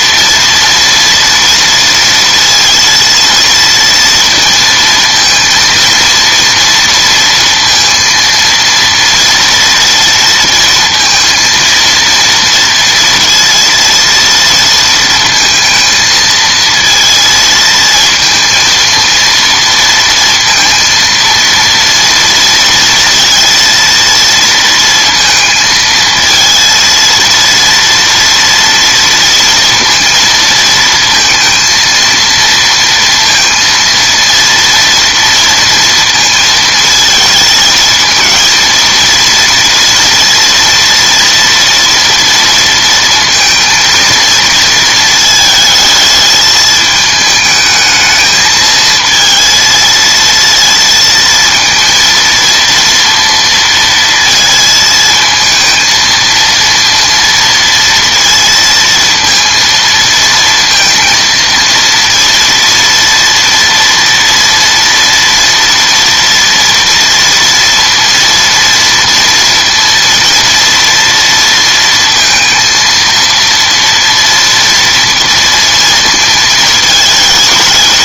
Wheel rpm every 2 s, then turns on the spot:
230, 230, 230, 230, 230, 230, 230, 230, 230, 230, 230, 230, 230, 230, 230, 230, 230, 230, 220, 230, 230, 230, 230, 220, 220, 230, 230, 220, 230, 230, 230, 230, 230, 230, 230, 230, 230, 230, 220.
none